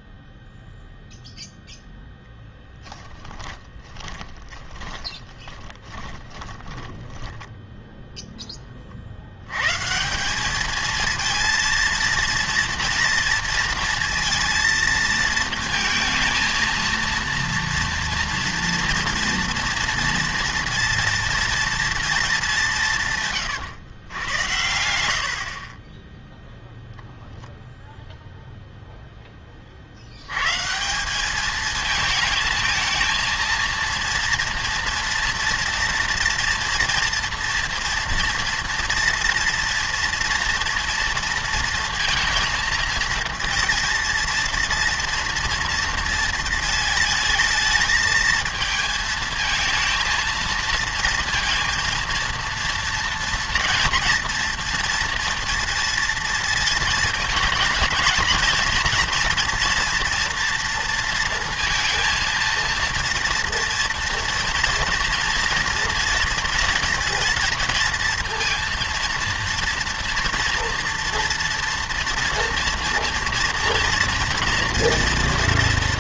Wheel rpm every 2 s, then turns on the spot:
0, 10, 30, 20, 30, 220, 230, 230, 230, 230, 230, 200, 90, 0, 0, 150, 220, 230, 230, 230, 230, 230, 230, 220, 220, 230, 230, 230, 220, 230, 230, 230, 230, 230, 230, 240, 230, 230.
2-8